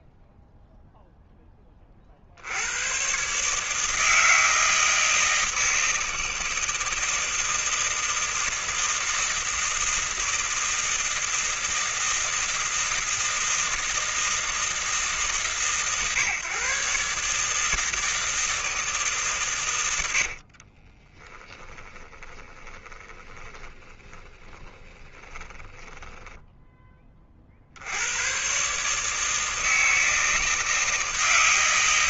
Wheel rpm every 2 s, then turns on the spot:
0, 100, 160, 160, 160, 160, 160, 160, 150, 150, 30, 20, 20, 20, 150, 160.
20-26